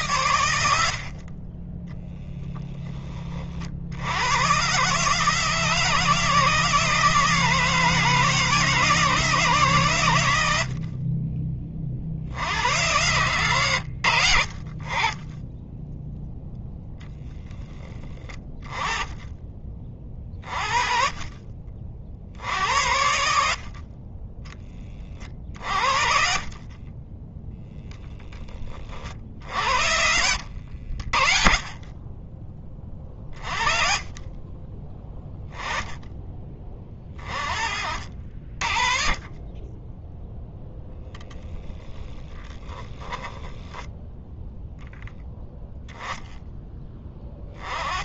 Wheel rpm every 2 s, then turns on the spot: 60, 20, 140, 160, 160, 50, 100, 20, 0, 20, 30, 70, 30, 20, 40, 60, 40, 10, 30, 40, 0, 10, 0, 10.
24-28 32-34 42-44